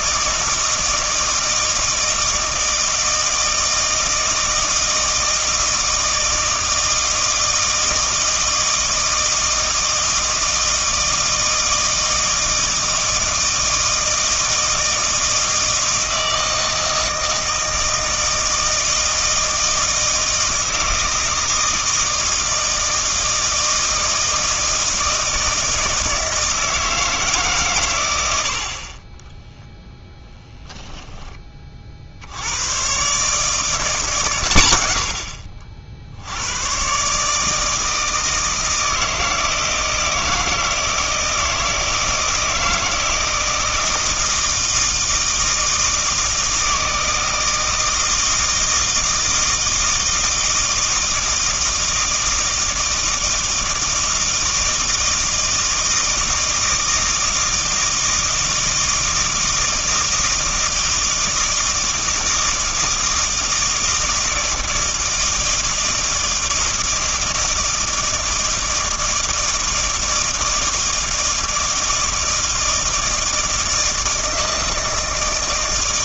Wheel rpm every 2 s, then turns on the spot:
160, 160, 160, 160, 160, 160, 160, 160, 160, 160, 160, 160, 160, 160, 50, 10, 100, 110, 110, 160, 160, 160, 160, 160, 160, 160, 160, 160, 160, 160, 160, 160, 160, 160, 160, 160, 160, 160.
30-32